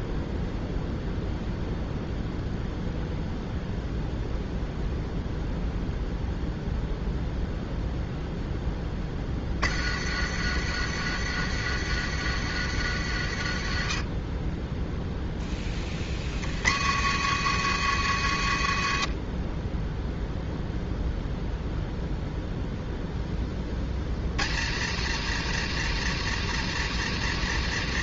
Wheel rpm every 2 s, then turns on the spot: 0, 0, 0, 0, 10, 100, 100, 10, 90, 90, 0, 0, 100, 120.
none